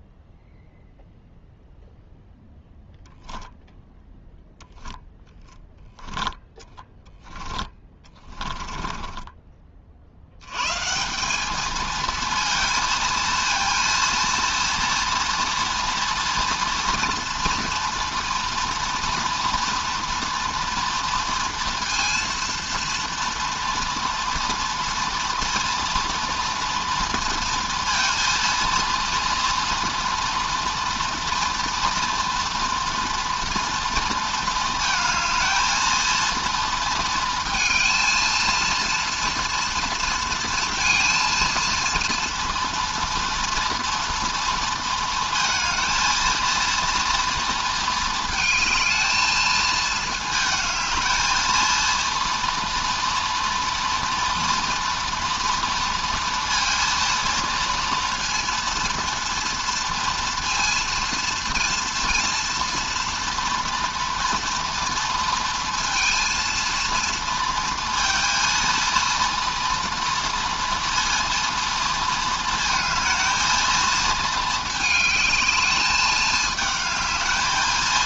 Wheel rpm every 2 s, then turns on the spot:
0, 0, 0, 10, 20, 120, 230, 230, 230, 230, 230, 230, 230, 230, 230, 230, 240, 230, 230, 230, 230, 230, 230, 230, 220, 220, 230, 230, 230, 230, 230, 230, 240, 230, 230, 230, 220, 220, 220.
6-10